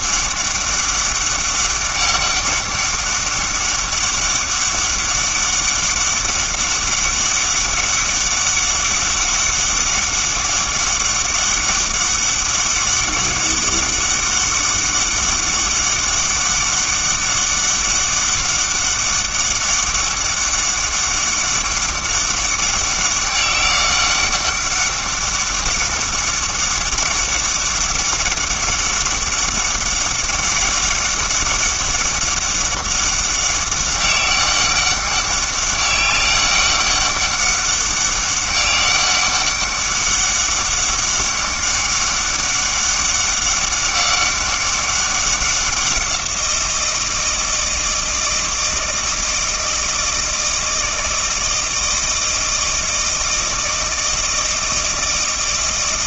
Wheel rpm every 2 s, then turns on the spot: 200, 200, 200, 200, 200, 200, 200, 200, 200, 200, 200, 200, 200, 200, 200, 200, 200, 190, 200, 200, 200, 200, 200, 170, 160, 160, 160, 160.
none